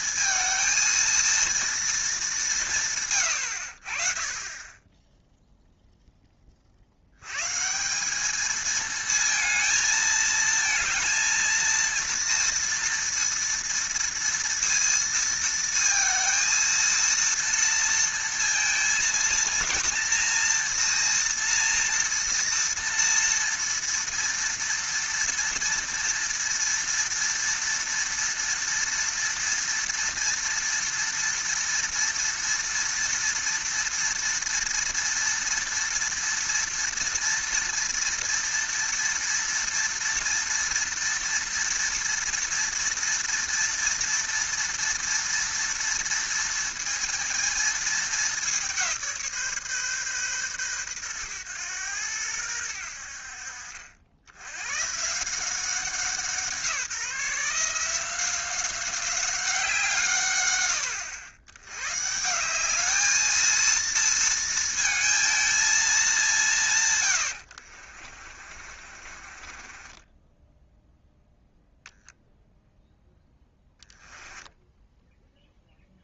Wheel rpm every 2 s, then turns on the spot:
220, 190, 30, 40, 220, 230, 230, 230, 230, 230, 230, 230, 230, 230, 230, 230, 230, 230, 230, 230, 230, 230, 230, 230, 190, 120, 90, 110, 170, 180, 100, 200, 230, 150, 40, 10, 0, 10.
68-72 74-76